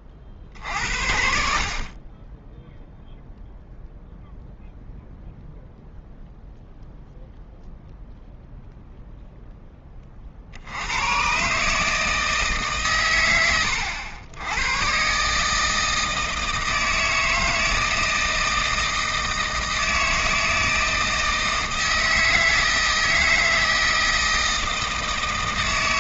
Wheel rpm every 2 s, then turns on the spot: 60, 0, 0, 0, 0, 60, 150, 100, 160, 160, 160, 160, 160.
none